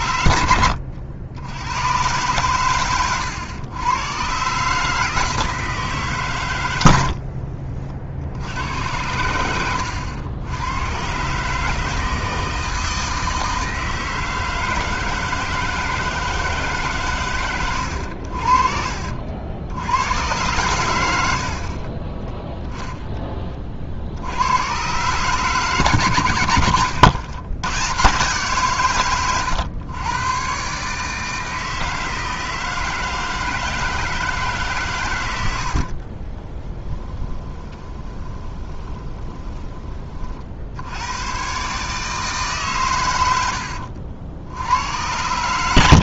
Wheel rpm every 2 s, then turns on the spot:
80, 120, 150, 90, 100, 110, 160, 160, 150, 50, 100, 10, 120, 110, 130, 140, 160, 130, 30, 20, 80, 120, 90.
22-24 26-28 36-40